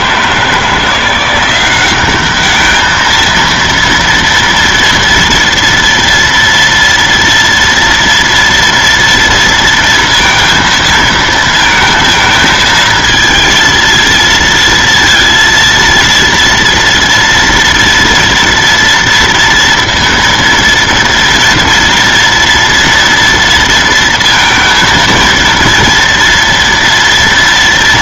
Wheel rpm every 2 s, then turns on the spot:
160, 210, 230, 230, 230, 230, 220, 230, 230, 230, 230, 230, 230, 230.
none